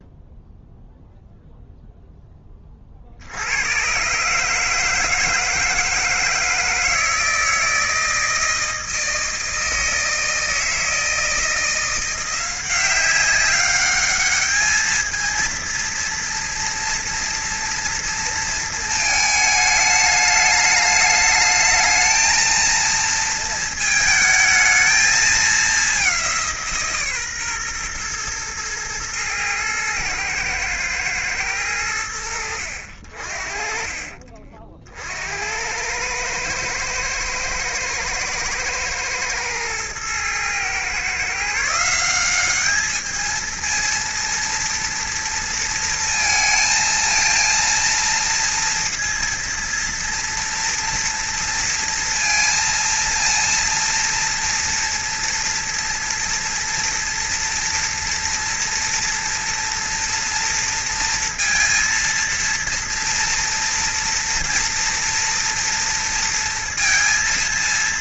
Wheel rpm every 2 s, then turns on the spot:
0, 50, 160, 160, 160, 160, 190, 220, 230, 220, 210, 230, 220, 150, 110, 110, 60, 60, 110, 110, 130, 220, 230, 230, 230, 230, 230, 230, 230, 230, 230, 230, 230, 230.
none